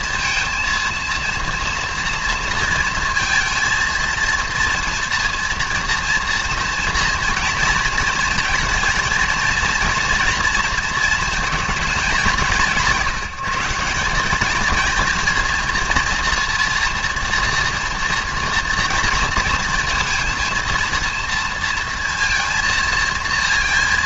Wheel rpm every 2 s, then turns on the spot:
230, 230, 230, 240, 220, 230, 190, 220, 230, 230, 230, 230.
none